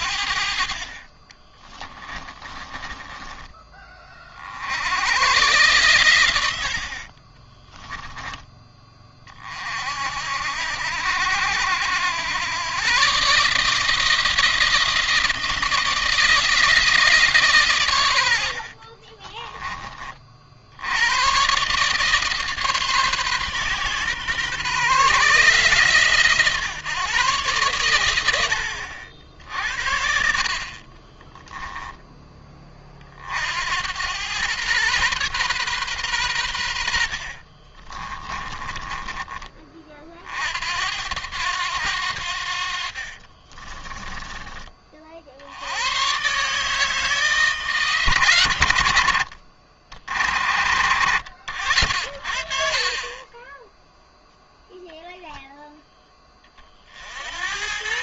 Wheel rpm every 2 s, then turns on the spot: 30, 20, 90, 50, 40, 70, 130, 160, 160, 40, 90, 140, 140, 140, 70, 40, 30, 120, 70, 20, 80, 50, 40, 150, 90, 60, 40, 0, 60.
0-2 18-20 30-32 36-38 42-44